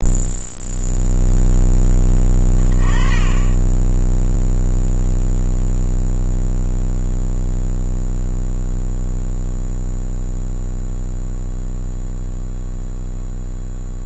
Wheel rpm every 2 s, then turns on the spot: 0, 20, 0, 0, 0, 0, 0.
none